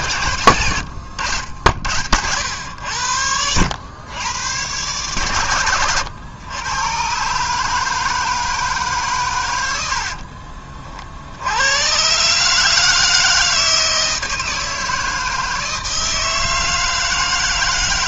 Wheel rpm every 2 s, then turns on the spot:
80, 80, 110, 120, 140, 50, 160, 160, 160.
0-2